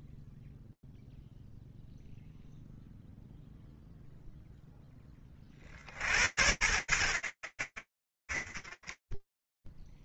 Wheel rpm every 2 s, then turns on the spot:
0, 10, 120, 50, 0.
none